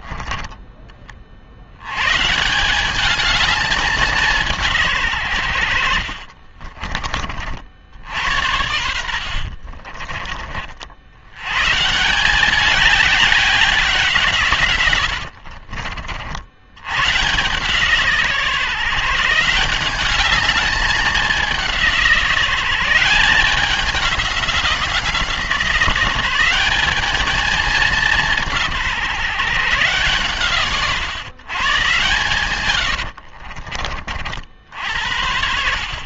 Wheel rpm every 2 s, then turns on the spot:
20, 190, 160, 30, 80, 60, 200, 120, 100, 140, 210, 170, 180, 200, 160, 130, 110, 70.
6-8 32-34